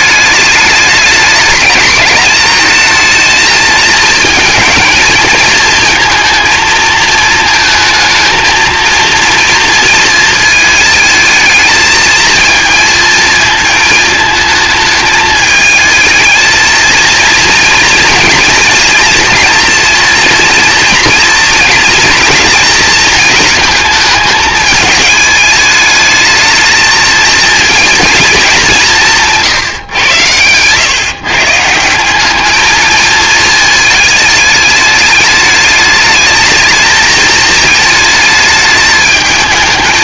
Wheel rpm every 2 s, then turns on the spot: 210, 230, 230, 220, 230, 220, 230, 220, 230, 230, 230, 230, 220, 220, 190, 130, 220, 210, 220, 220.
none